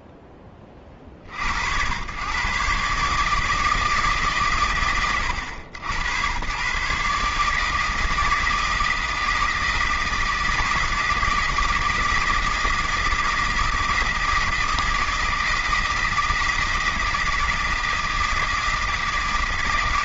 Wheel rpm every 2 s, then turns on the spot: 20, 130, 140, 130, 160, 160, 160, 160, 160, 160.
none